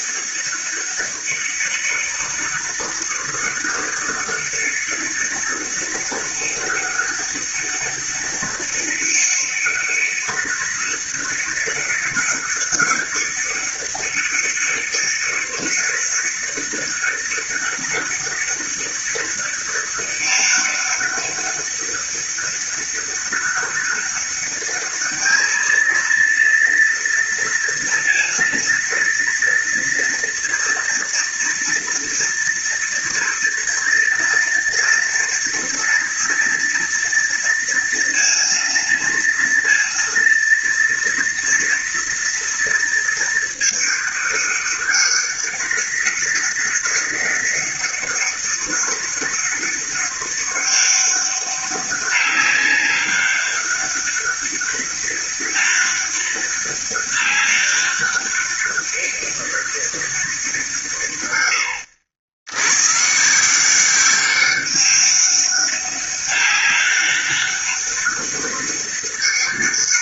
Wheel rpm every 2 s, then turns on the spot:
200, 200, 200, 200, 200, 200, 200, 200, 200, 200, 200, 200, 210, 230, 230, 230, 230, 230, 230, 230, 230, 220, 200, 200, 200, 200, 200, 200, 200, 200, 130, 140, 200, 200, 200.
none